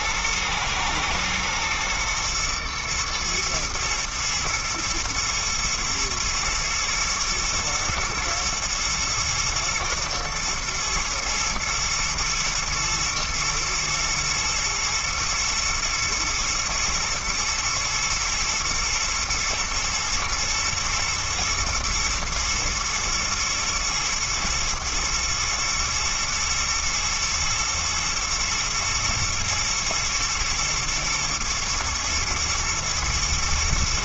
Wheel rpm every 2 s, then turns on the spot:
110, 110, 120, 120, 120, 110, 120, 120, 120, 110, 120, 120, 120, 120, 110, 110, 110.
none